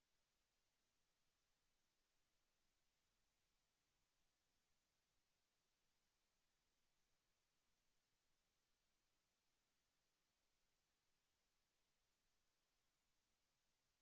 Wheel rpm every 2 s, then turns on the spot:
0, 0, 0, 0, 0, 0, 0.
none